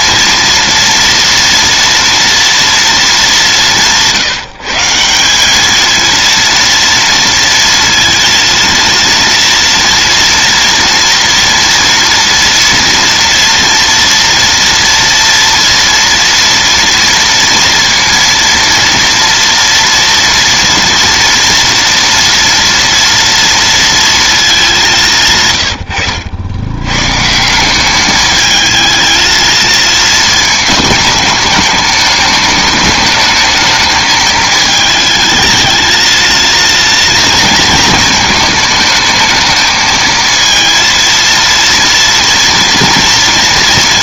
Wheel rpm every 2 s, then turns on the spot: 230, 220, 170, 230, 230, 230, 230, 230, 230, 230, 240, 230, 180, 130, 220, 210, 210, 220, 230, 210, 230, 230.
none